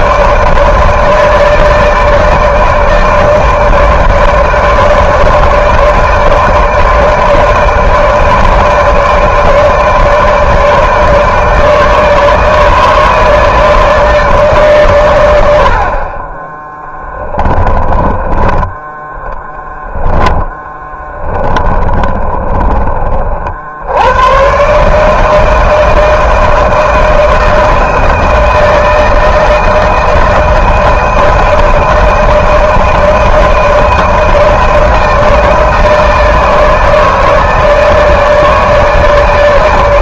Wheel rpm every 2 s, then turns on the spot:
150, 160, 150, 160, 150, 150, 150, 140, 20, 20, 10, 30, 120, 160, 160, 160, 160, 160, 160, 160.
20-24